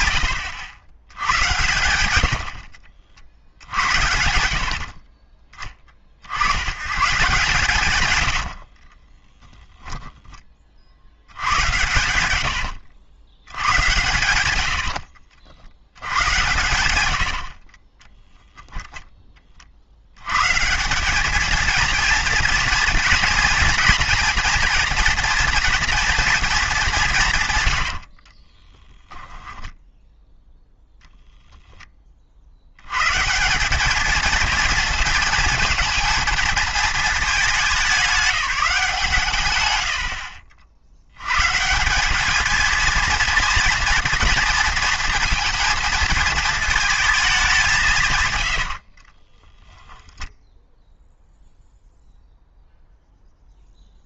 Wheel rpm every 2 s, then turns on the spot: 100, 60, 70, 100, 50, 30, 80, 80, 100, 10, 150, 230, 230, 220, 20, 0, 80, 230, 230, 180, 60, 220, 230, 220, 90, 0, 0.
4-6 8-10 12-16 28-30 48-50